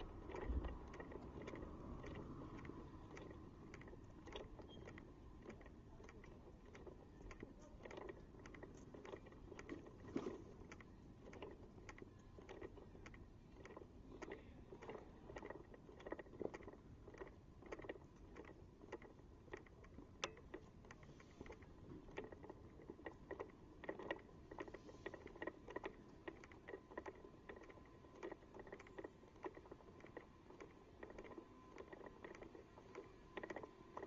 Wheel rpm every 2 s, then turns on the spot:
0, 0, 0, 0, 0, 0, 0, 0, 0, 0, 0, 0, 0, 0, 0, 0, 0.
none